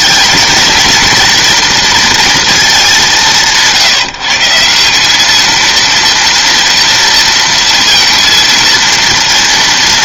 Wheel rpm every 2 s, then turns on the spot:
230, 220, 170, 230, 230.
none